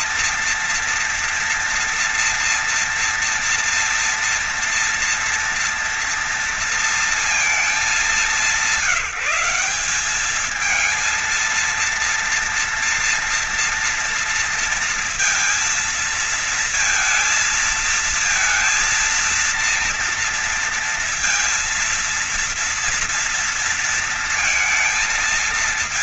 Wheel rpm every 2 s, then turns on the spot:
230, 230, 230, 230, 200, 200, 230, 230, 230, 230, 230, 230, 230.
none